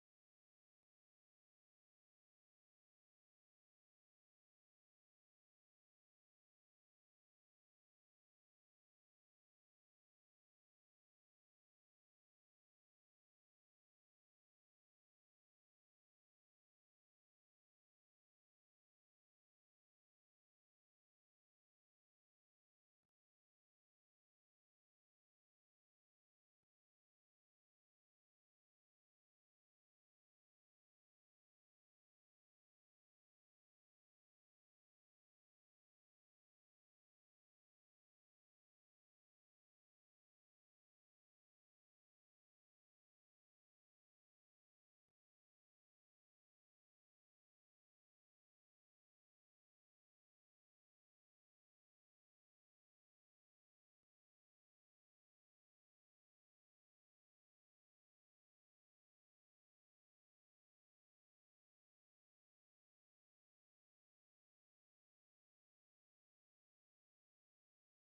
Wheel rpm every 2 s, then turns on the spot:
0, 0, 0, 0, 0, 0, 0, 0, 0, 0, 0, 0, 0, 0, 0, 0, 0, 0, 0, 0, 0, 0, 0, 0, 0, 0, 0, 0, 0, 0, 0, 0, 0, 0.
none